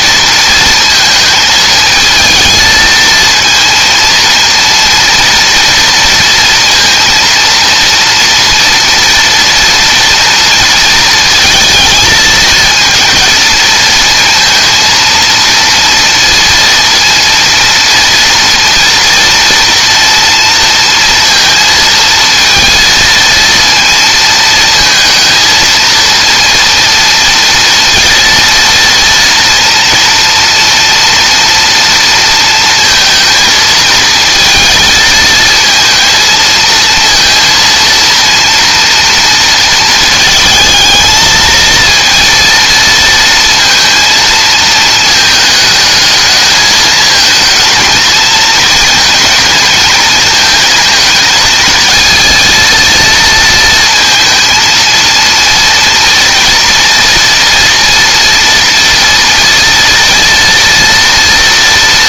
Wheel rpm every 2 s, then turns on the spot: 230, 220, 230, 230, 230, 230, 230, 230, 230, 230, 230, 230, 220, 230, 230, 230, 230, 230, 230, 230, 220, 230, 220, 220, 220, 220, 230, 230, 230, 230, 230.
none